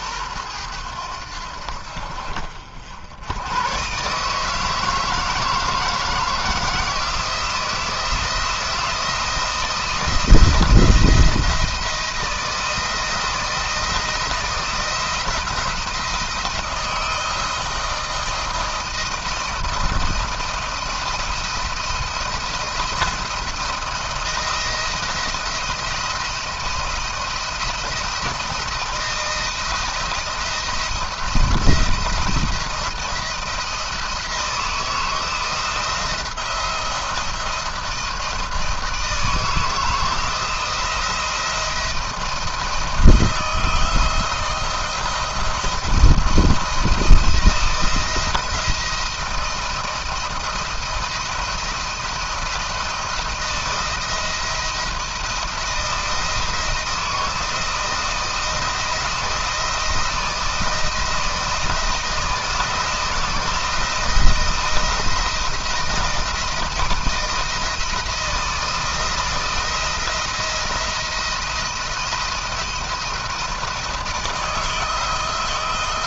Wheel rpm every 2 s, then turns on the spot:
100, 60, 150, 170, 170, 160, 160, 170, 160, 160, 170, 170, 170, 170, 170, 170, 170, 170, 170, 160, 160, 160, 170, 170, 170, 170, 170, 160, 160, 160, 160, 170, 170, 160, 170, 170, 170, 160.
none